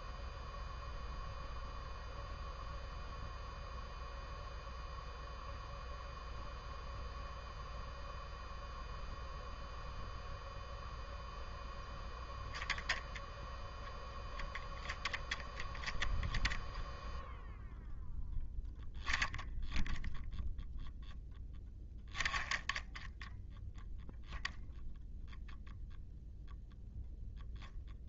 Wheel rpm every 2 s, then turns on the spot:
0, 0, 0, 0, 0, 0, 0, 10, 0, 0, 0, 0, 0, 0.
none